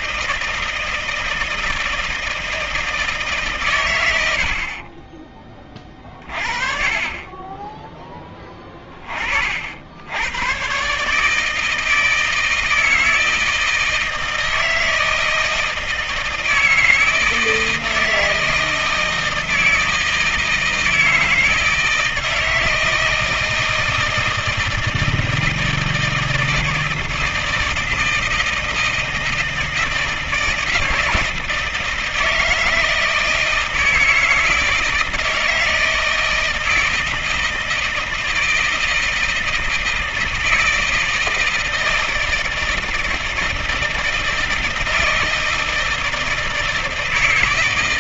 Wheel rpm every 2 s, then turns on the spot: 160, 160, 50, 40, 20, 130, 160, 160, 160, 160, 160, 160, 160, 160, 160, 160, 160, 160, 160, 160, 160, 160, 160, 160.
4-6